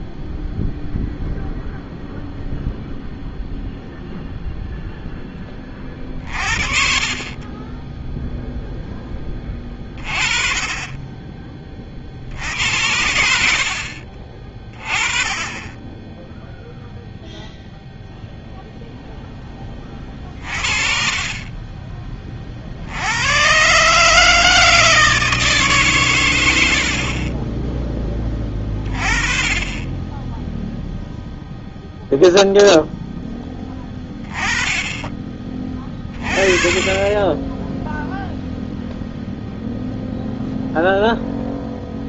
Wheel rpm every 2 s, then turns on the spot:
0, 0, 20, 20, 20, 40, 70, 10, 0, 10, 40, 100, 150, 30, 20, 0, 10, 20, 10, 0, 0.
none